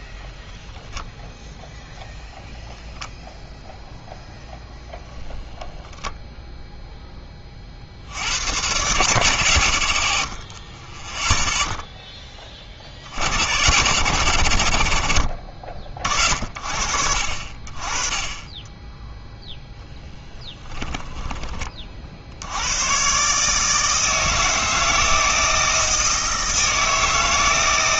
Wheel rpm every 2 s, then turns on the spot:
0, 0, 0, 0, 120, 30, 30, 90, 60, 10, 10, 100, 160, 160.
20-22